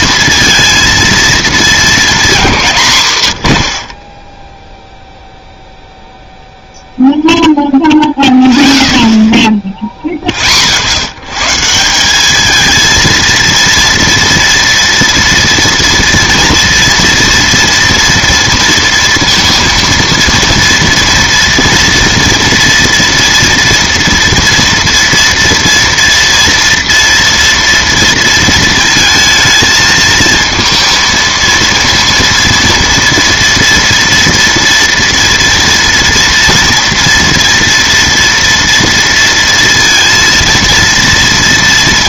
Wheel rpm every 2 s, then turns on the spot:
230, 200, 10, 0, 0, 30, 220, 240, 230, 230, 230, 230, 230, 230, 230, 230, 230, 230, 230, 230, 230.
none